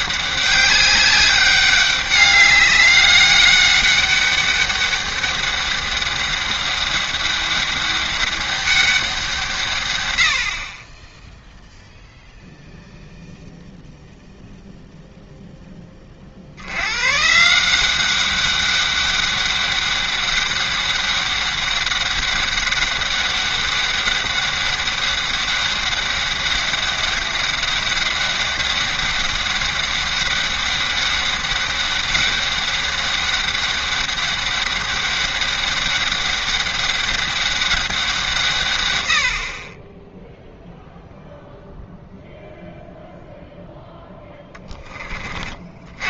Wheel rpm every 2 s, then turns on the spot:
200, 200, 200, 200, 200, 40, 0, 0, 90, 200, 200, 200, 200, 200, 200, 200, 200, 200, 200, 120, 0, 0, 20.
none